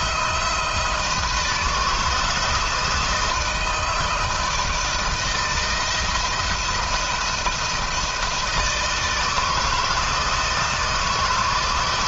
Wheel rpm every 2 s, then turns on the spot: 170, 160, 160, 170, 160, 160.
none